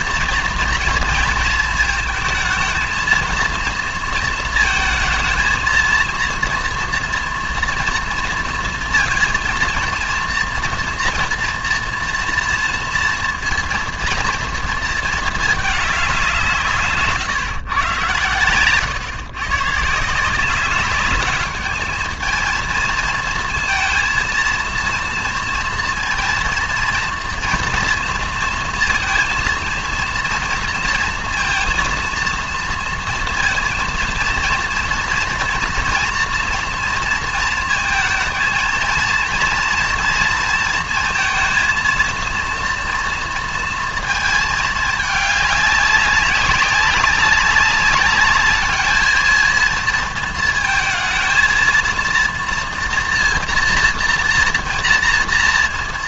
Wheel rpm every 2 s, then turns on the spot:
240, 230, 230, 240, 230, 230, 230, 230, 150, 120, 190, 220, 230, 230, 230, 230, 230, 230, 230, 230, 230, 230, 220, 190, 210, 230, 230, 230.
18-20